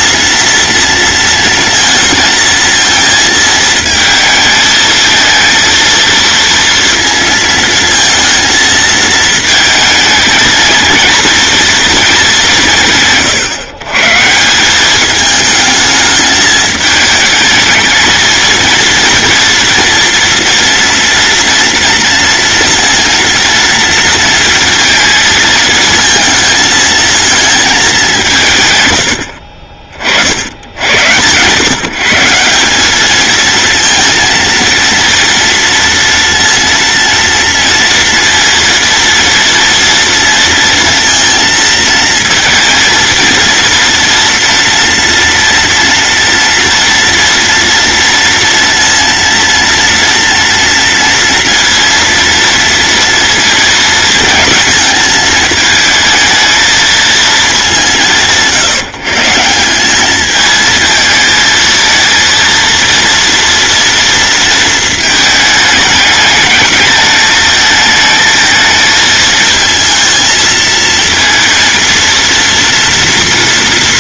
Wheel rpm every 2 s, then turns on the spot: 230, 230, 220, 230, 230, 220, 170, 190, 210, 230, 240, 230, 220, 220, 110, 80, 200, 230, 230, 230, 230, 230, 230, 240, 230, 230, 230, 220, 220, 160, 220, 230, 230, 220, 220, 220, 230.
none